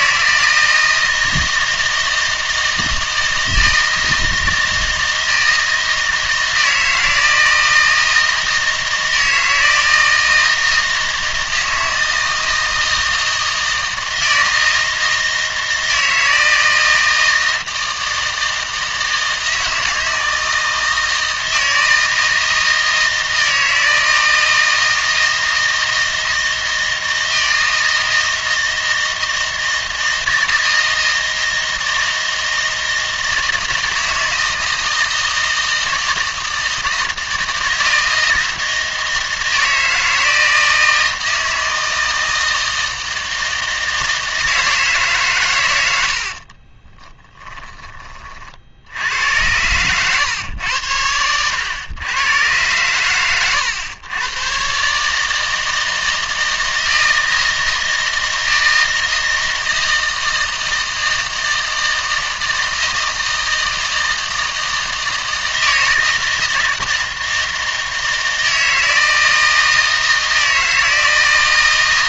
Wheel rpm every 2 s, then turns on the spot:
160, 160, 160, 160, 160, 160, 160, 160, 160, 160, 160, 160, 160, 160, 160, 160, 160, 160, 160, 160, 160, 160, 160, 30, 80, 100, 110, 140, 160, 160, 160, 160, 160, 160, 160, 160.
46-48